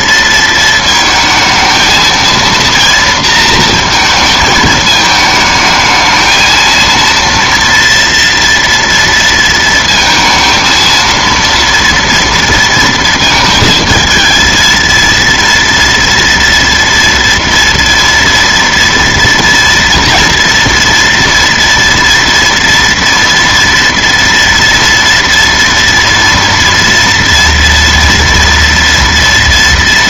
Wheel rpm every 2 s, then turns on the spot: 230, 230, 220, 230, 230, 230, 230, 230, 230, 230, 230, 230, 230, 230, 240.
none